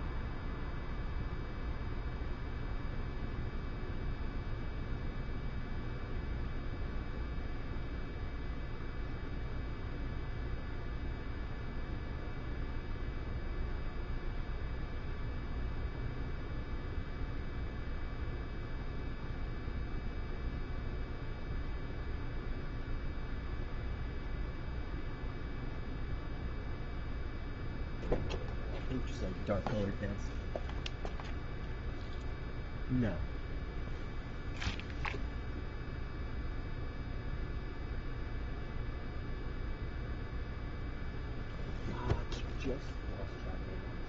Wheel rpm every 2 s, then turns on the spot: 0, 0, 0, 0, 0, 0, 0, 0, 0, 0, 0, 0, 0, 0, 0, 0, 0, 0, 0, 0, 0, 0.
none